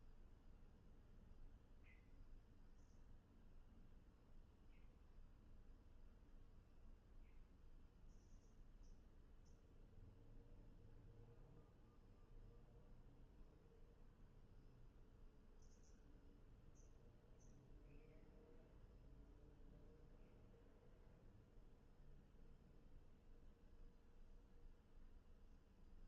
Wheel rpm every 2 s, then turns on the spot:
0, 0, 0, 0, 0, 0, 0, 0, 0, 0, 0, 0, 0.
none